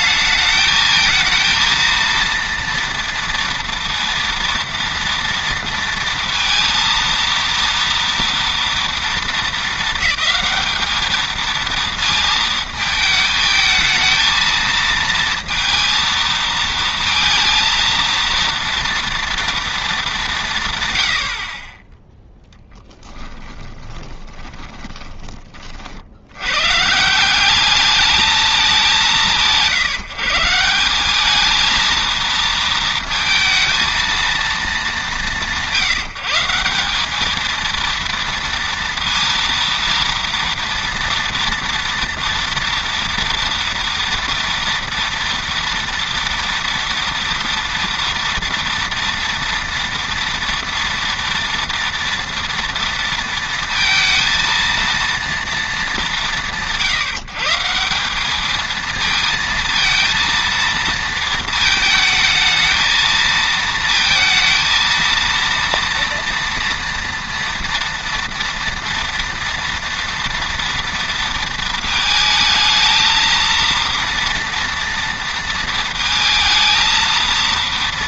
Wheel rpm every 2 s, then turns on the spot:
220, 230, 230, 230, 230, 210, 220, 230, 220, 230, 130, 10, 30, 120, 190, 170, 230, 210, 170, 230, 230, 230, 230, 230, 230, 230, 230, 230, 160, 220, 230, 220, 230, 230, 230, 230, 220, 230, 230.
24-26